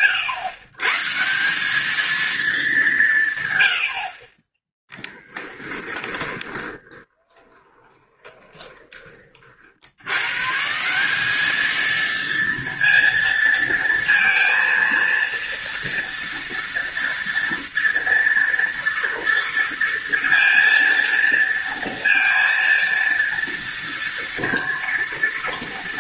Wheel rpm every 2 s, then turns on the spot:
130, 190, 10, 20, 20, 160, 230, 230, 230, 230, 230, 230, 230.
4-10